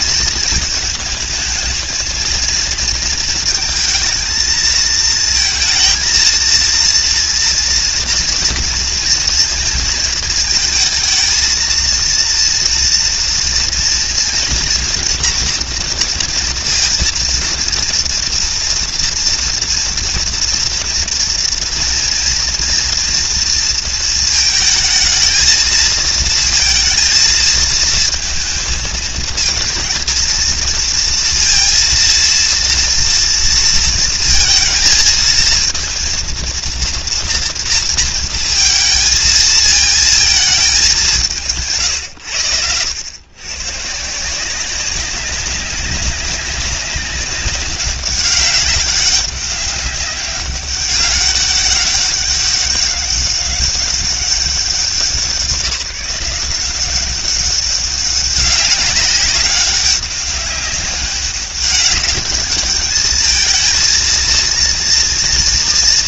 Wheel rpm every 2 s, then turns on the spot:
220, 230, 220, 230, 240, 220, 230, 230, 230, 230, 240, 230, 220, 230, 230, 230, 230, 230, 230, 230, 200, 100, 190, 190, 200, 200, 200, 180, 190, 190, 200, 210, 230.
none